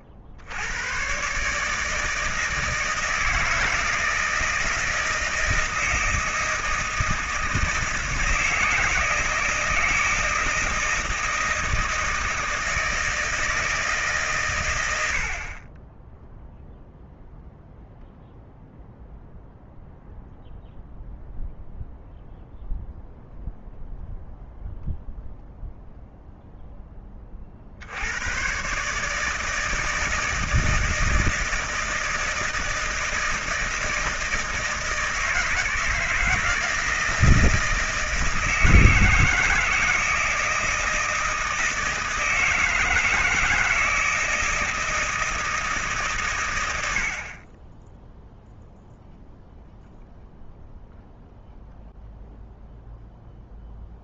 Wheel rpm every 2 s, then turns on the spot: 70, 160, 160, 160, 160, 160, 160, 120, 0, 0, 0, 0, 0, 0, 120, 160, 160, 160, 160, 160, 160, 160, 160, 110, 0, 0, 0.
none